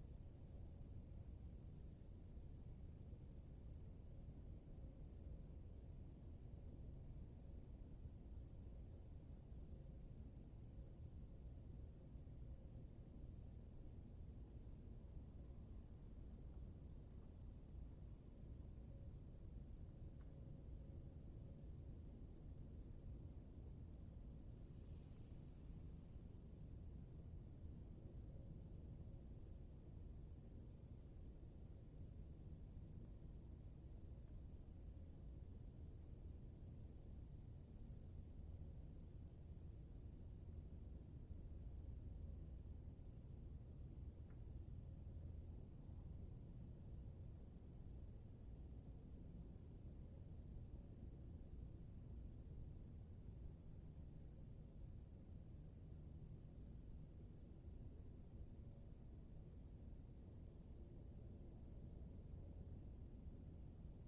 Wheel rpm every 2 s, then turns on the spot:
0, 0, 0, 0, 0, 0, 0, 0, 0, 0, 0, 0, 0, 0, 0, 0, 0, 0, 0, 0, 0, 0, 0, 0, 0, 0, 0, 0, 0, 0, 0, 0.
none